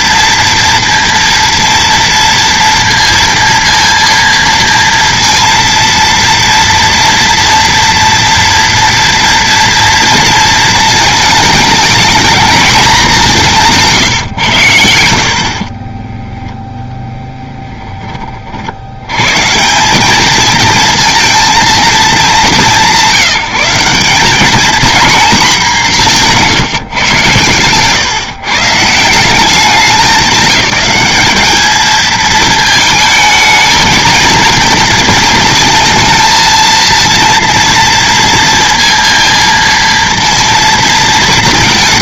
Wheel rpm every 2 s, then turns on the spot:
230, 230, 230, 230, 230, 230, 220, 90, 0, 60, 220, 190, 230, 150, 150, 190, 220, 230, 230, 230, 230.
none